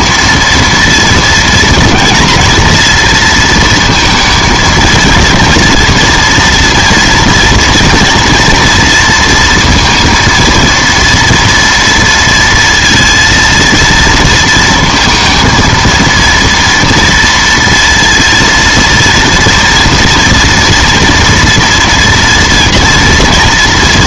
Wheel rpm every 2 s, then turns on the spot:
230, 230, 230, 240, 230, 230, 230, 230, 230, 230, 230, 230.
none